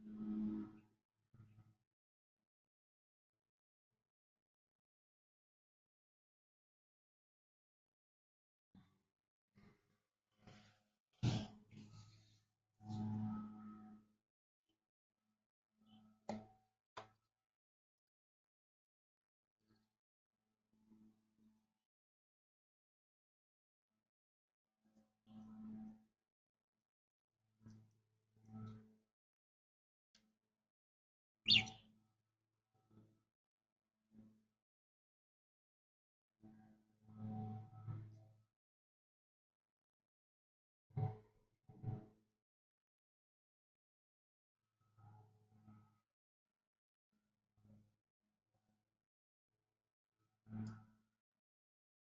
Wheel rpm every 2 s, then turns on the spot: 0, 0, 0, 0, 0, 0, 0, 0, 0, 0, 0, 0, 0, 0, 0, 0, 0, 0, 0, 0, 0, 0, 0, 0, 0, 0.
none